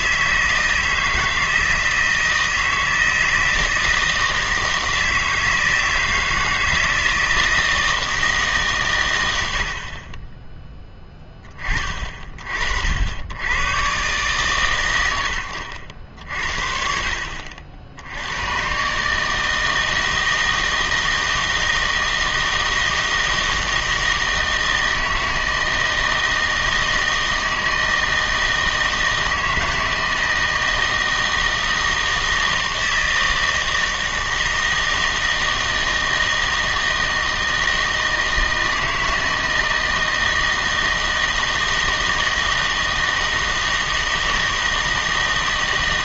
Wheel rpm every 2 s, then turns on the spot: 160, 160, 160, 160, 150, 10, 50, 120, 50, 120, 160, 160, 160, 160, 160, 160, 160, 160, 160, 160, 160, 160, 160.
none